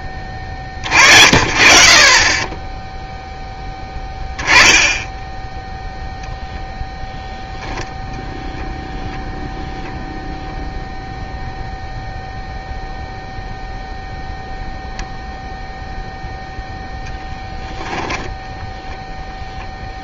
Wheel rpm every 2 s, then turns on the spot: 40, 0, 10, 0, 0, 0, 0, 0, 0, 0.
none